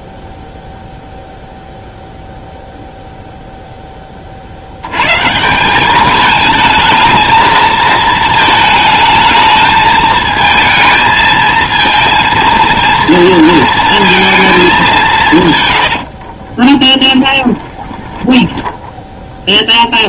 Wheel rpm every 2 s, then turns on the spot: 0, 0, 80, 220, 220, 220, 230, 200, 20, 10.
16-20